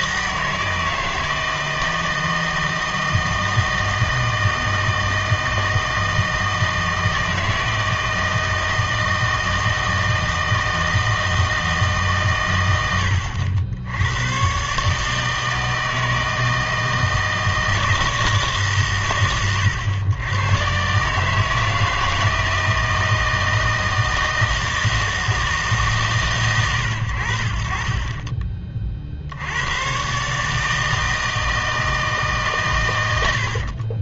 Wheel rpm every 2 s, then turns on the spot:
160, 160, 160, 160, 160, 160, 100, 130, 160, 140, 120, 160, 160, 100, 30, 150, 120.
none